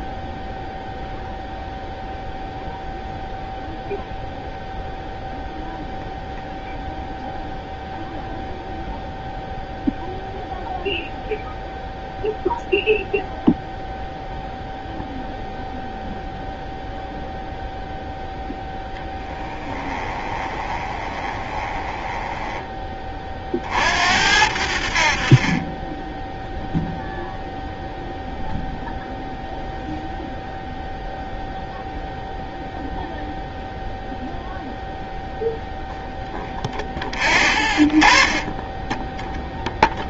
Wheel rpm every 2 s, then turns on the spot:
0, 0, 0, 0, 0, 0, 0, 0, 0, 0, 20, 20, 60, 0, 0, 0, 0, 0, 10, 20.
20-22